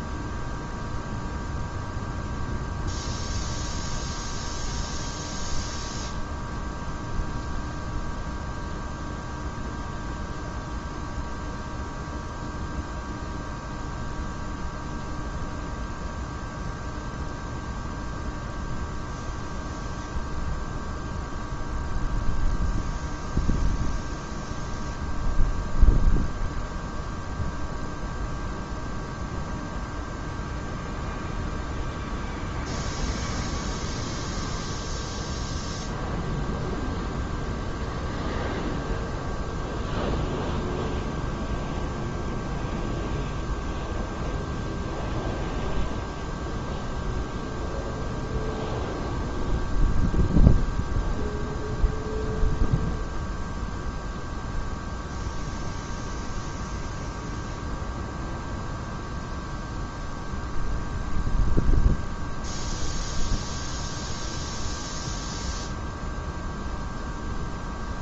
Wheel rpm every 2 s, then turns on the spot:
0, 0, 0, 0, 0, 0, 0, 0, 0, 0, 0, 0, 0, 0, 0, 0, 0, 0, 0, 0, 0, 0, 0, 0, 0, 0, 0, 0, 0, 0, 0, 0, 0, 0.
none